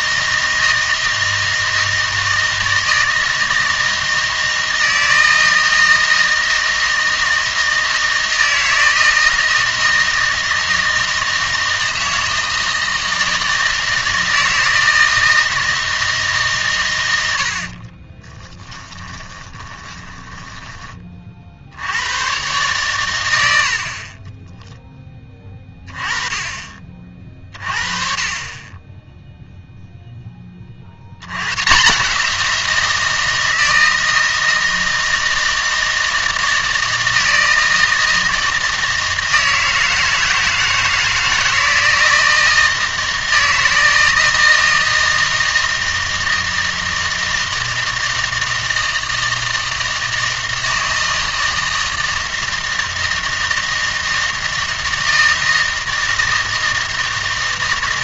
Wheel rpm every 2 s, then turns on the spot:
160, 160, 160, 160, 160, 160, 160, 160, 130, 10, 20, 120, 10, 30, 20, 30, 170, 160, 160, 160, 170, 160, 160, 160, 160, 160, 160, 160, 160.
18-22